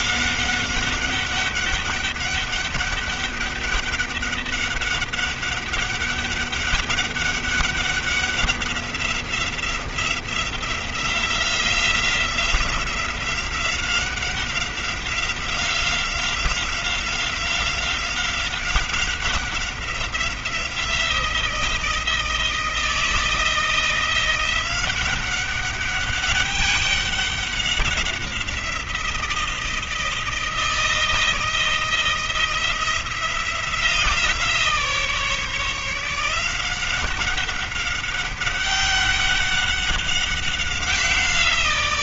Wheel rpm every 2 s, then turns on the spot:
190, 200, 200, 200, 190, 180, 180, 190, 180, 190, 180, 160, 180, 200, 170, 160, 170, 160, 180, 200, 190.
none